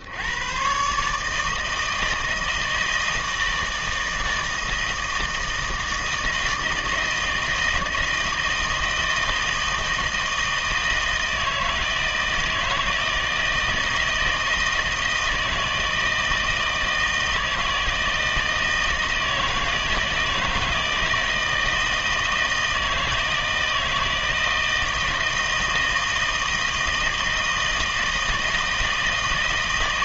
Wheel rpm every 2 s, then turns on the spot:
120, 160, 160, 160, 160, 160, 160, 160, 160, 160, 160, 160, 160, 160, 160.
none